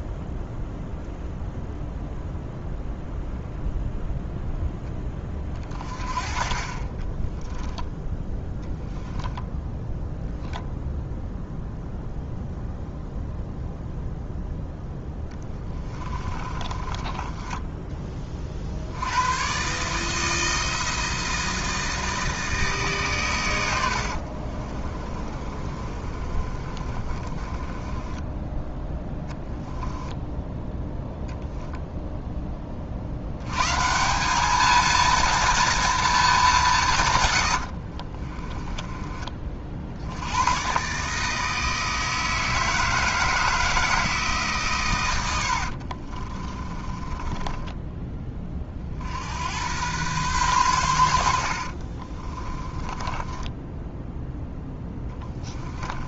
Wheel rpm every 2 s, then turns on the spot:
0, 0, 10, 40, 10, 0, 0, 0, 20, 60, 160, 140, 30, 30, 10, 0, 50, 230, 170, 20, 130, 160, 120, 30, 50, 100, 20, 10.
8-10 16-18 24-28 46-48 52-56